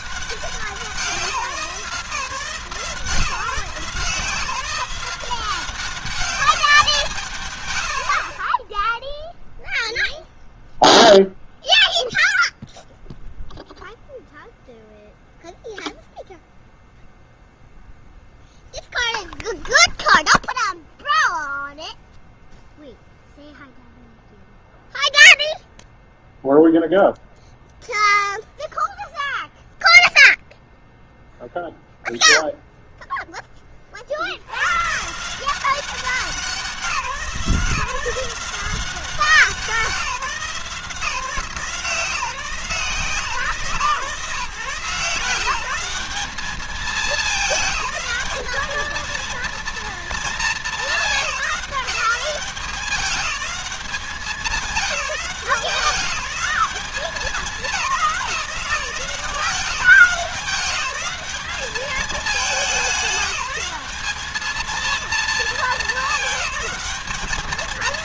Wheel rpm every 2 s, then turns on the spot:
180, 160, 180, 170, 10, 0, 0, 0, 0, 0, 0, 0, 0, 0, 0, 0, 0, 110, 180, 180, 170, 160, 150, 200, 220, 210, 200, 200, 200, 190, 190, 190, 220, 210.
none